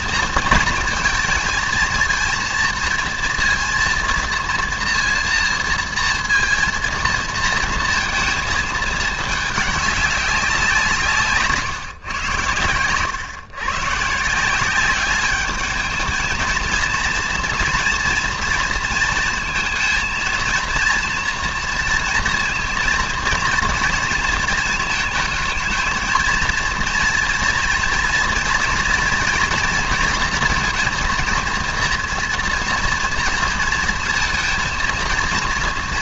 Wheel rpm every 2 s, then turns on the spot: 230, 230, 230, 230, 220, 180, 110, 180, 230, 230, 230, 230, 230, 230, 230, 230, 240, 230.
12-14